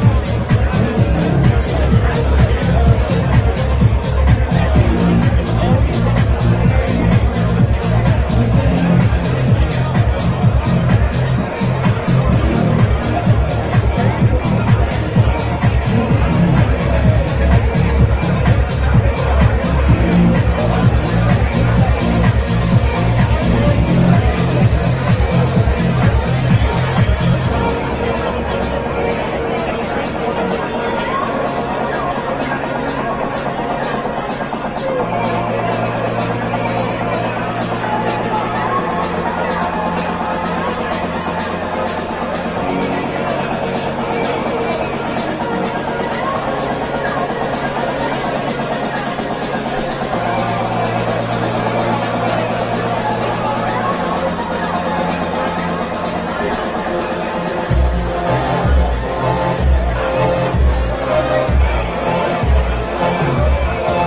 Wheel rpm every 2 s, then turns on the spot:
0, 0, 0, 0, 0, 0, 0, 0, 0, 0, 0, 0, 0, 0, 0, 0, 0, 0, 0, 0, 0, 0, 0, 0, 0, 0, 0, 0, 0, 0, 0, 0.
none